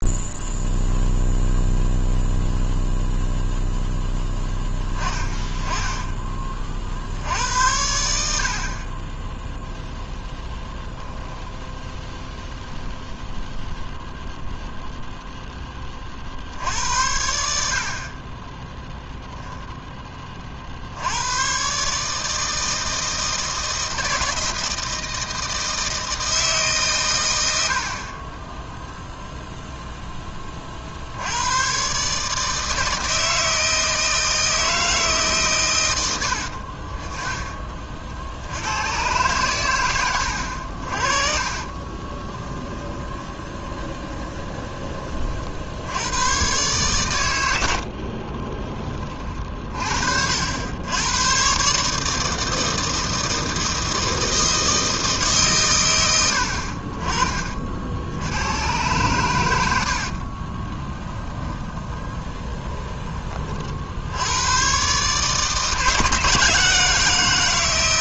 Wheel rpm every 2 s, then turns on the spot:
0, 0, 20, 50, 30, 0, 0, 0, 60, 10, 50, 160, 160, 140, 0, 40, 160, 160, 40, 90, 60, 20, 20, 130, 20, 90, 160, 160, 40, 110, 20, 20, 120, 160.
42-44 60-64